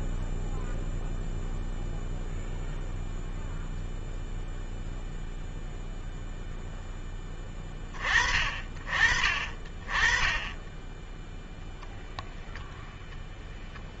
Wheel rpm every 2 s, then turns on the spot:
0, 0, 0, 0, 10, 10, 10.
none